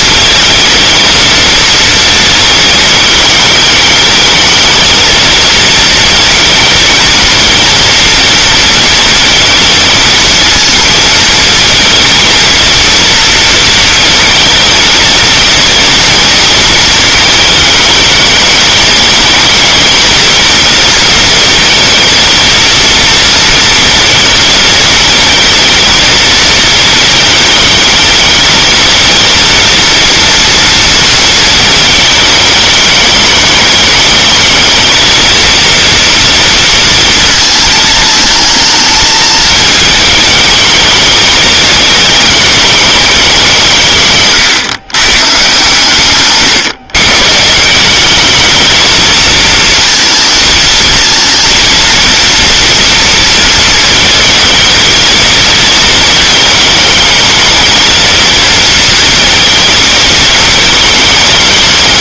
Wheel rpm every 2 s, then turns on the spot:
220, 220, 220, 230, 230, 230, 230, 220, 220, 220, 230, 230, 220, 220, 220, 230, 210, 220, 230, 220, 210, 210, 120, 140, 220, 220, 240, 220, 220, 230, 220.
none